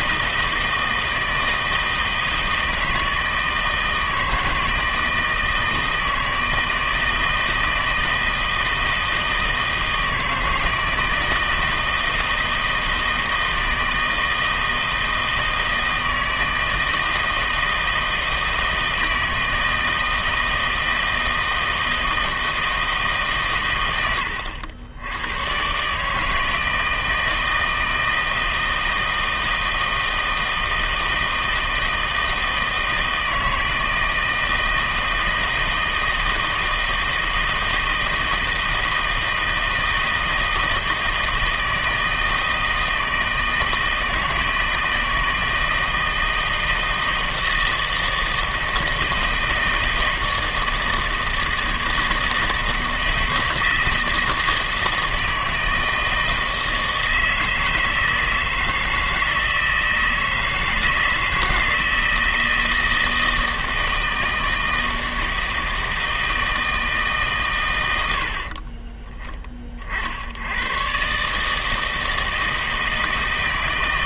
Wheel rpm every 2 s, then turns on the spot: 160, 160, 160, 160, 160, 160, 160, 160, 160, 160, 160, 160, 90, 160, 160, 160, 160, 160, 160, 160, 160, 160, 160, 160, 160, 160, 160, 160, 160, 160, 160, 160, 160, 160, 30, 110, 160.
none